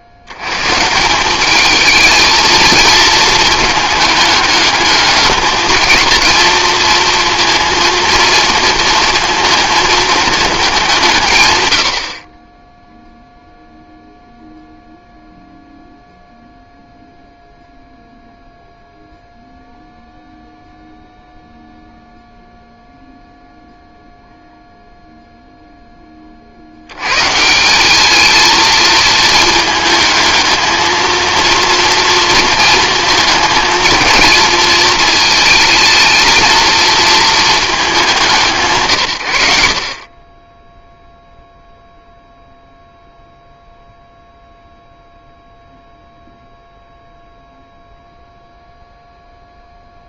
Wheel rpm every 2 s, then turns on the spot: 140, 220, 220, 230, 220, 190, 10, 0, 0, 0, 0, 0, 0, 60, 220, 220, 230, 220, 230, 150, 10, 0, 0, 0, 0.
none